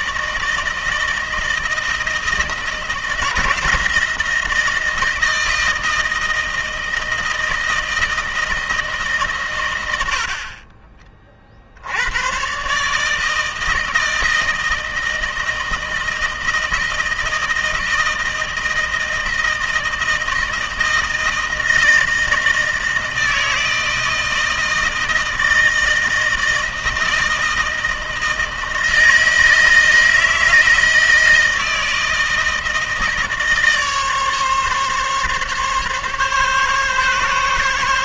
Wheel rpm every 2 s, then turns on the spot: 160, 160, 160, 160, 150, 40, 140, 160, 160, 160, 160, 160, 160, 160, 160, 160, 160, 140, 140.
none